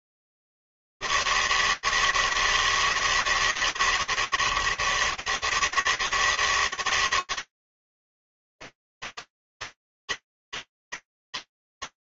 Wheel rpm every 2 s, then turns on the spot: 80, 160, 140, 150, 160, 160.
none